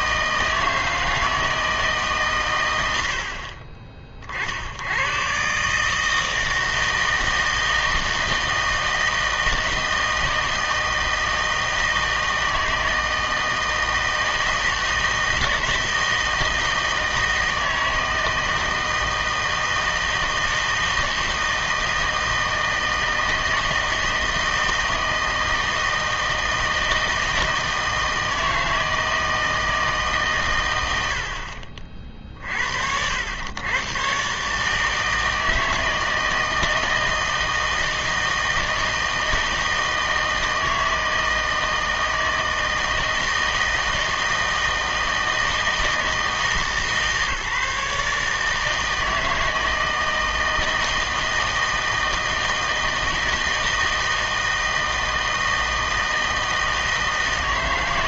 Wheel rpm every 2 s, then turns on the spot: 160, 120, 70, 160, 160, 160, 160, 160, 160, 160, 160, 160, 160, 160, 160, 110, 60, 150, 160, 160, 160, 160, 160, 160, 160, 160, 160, 160, 160.
none